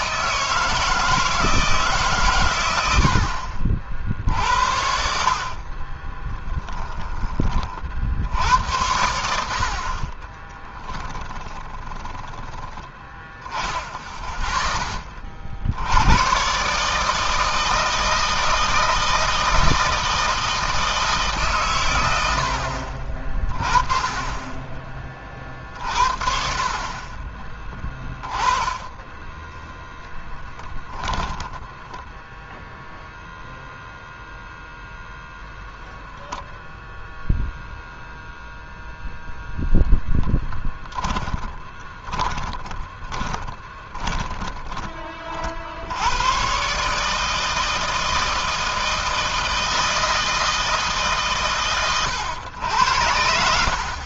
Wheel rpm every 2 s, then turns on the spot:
160, 90, 60, 10, 80, 20, 20, 20, 150, 160, 160, 50, 30, 30, 20, 10, 0, 0, 0, 0, 10, 20, 30, 150, 160, 150, 80.
10-12 40-44